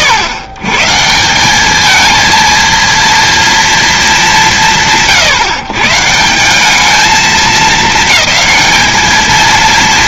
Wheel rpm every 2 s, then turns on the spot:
130, 230, 130, 200, 220.
none